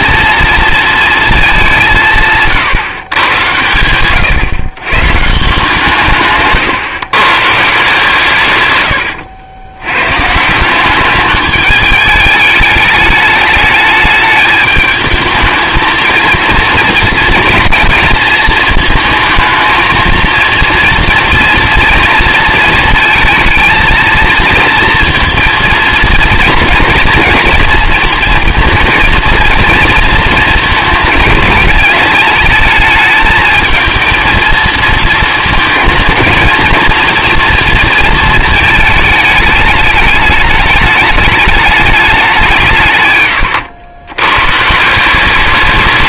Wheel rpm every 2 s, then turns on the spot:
230, 150, 120, 150, 130, 170, 210, 210, 230, 220, 230, 230, 220, 230, 230, 230, 220, 220, 220, 220, 210, 180, 130.
none